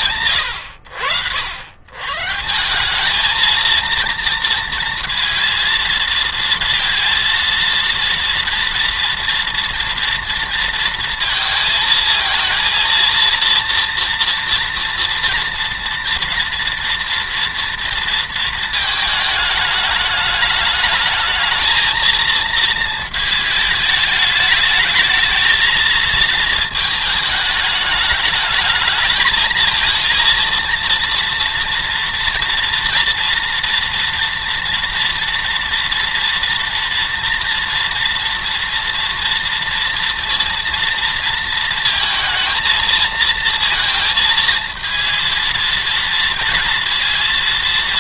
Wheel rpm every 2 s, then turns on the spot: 70, 190, 230, 230, 230, 230, 230, 240, 240, 220, 210, 230, 220, 220, 220, 230, 230, 230, 230, 230, 230, 220, 230, 230.
none